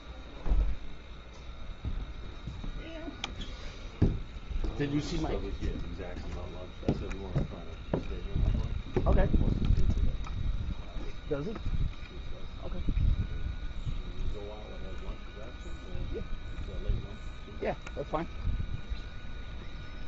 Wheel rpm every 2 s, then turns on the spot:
0, 0, 0, 0, 0, 0, 0, 0, 0, 0.
none